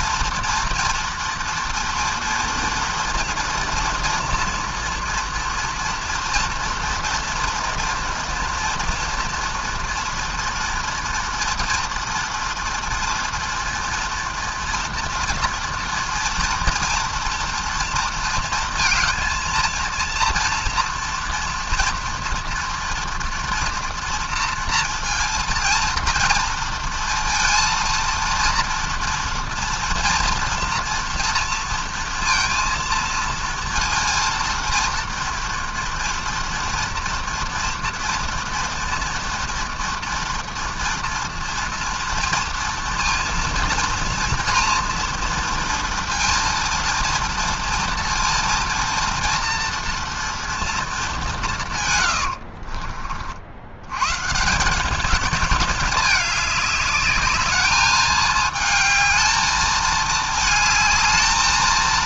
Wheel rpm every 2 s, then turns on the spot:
230, 230, 230, 230, 240, 230, 240, 230, 230, 220, 230, 240, 230, 230, 230, 230, 230, 230, 230, 230, 230, 230, 230, 230, 230, 220, 40, 180, 200, 220, 220.
none